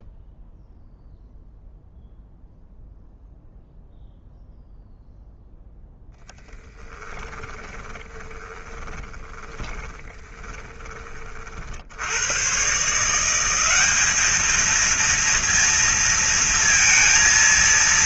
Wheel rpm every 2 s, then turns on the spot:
0, 0, 0, 10, 20, 30, 150, 230, 230.
6-10